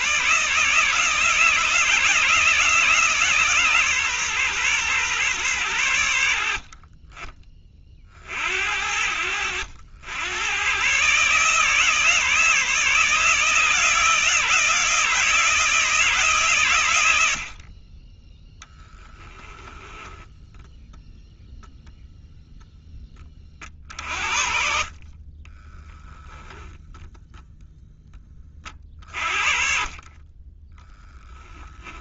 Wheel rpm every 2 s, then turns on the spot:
160, 160, 120, 20, 70, 140, 160, 160, 100, 10, 0, 10, 40, 0, 40, 0.
none